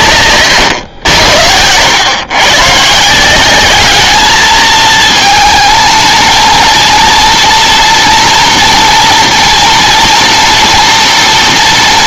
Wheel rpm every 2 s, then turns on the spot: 120, 130, 220, 230, 230, 230.
none